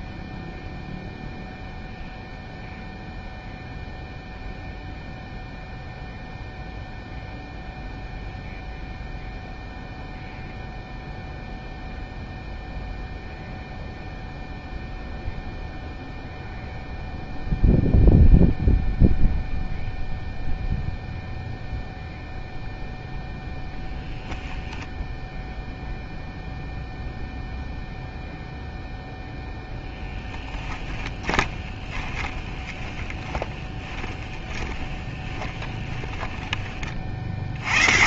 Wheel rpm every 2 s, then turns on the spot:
0, 0, 0, 0, 0, 0, 0, 0, 0, 0, 0, 0, 0, 0, 0, 10, 20, 20, 30.
30-36